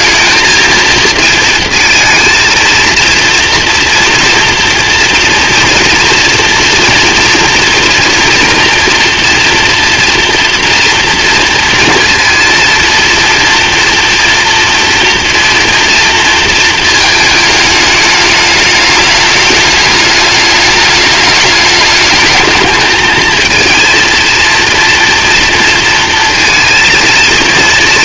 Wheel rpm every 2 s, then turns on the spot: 220, 230, 230, 230, 240, 230, 230, 230, 230, 210, 210, 220, 230, 230.
none